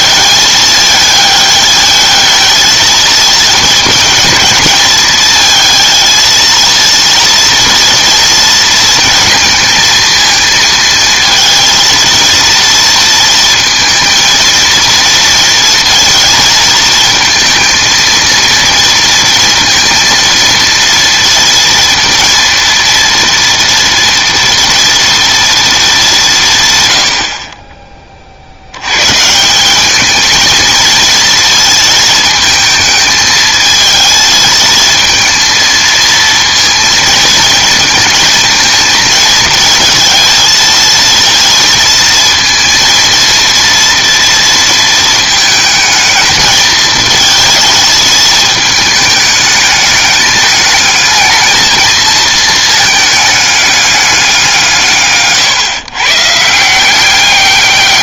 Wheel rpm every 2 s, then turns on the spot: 220, 220, 220, 230, 230, 230, 230, 230, 230, 230, 230, 230, 230, 140, 80, 220, 220, 220, 230, 220, 230, 230, 230, 220, 220, 210, 220, 170, 160.
none